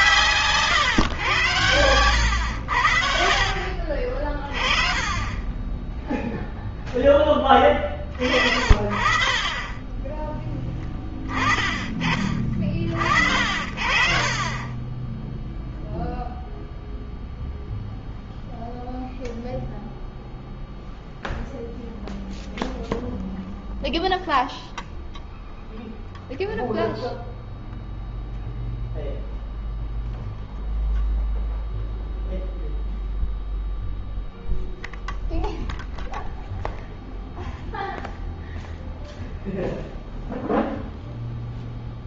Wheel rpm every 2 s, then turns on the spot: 110, 70, 30, 10, 40, 10, 40, 20, 0, 0, 0, 0, 0, 0, 0, 0, 0, 0, 0, 0, 0.
14-16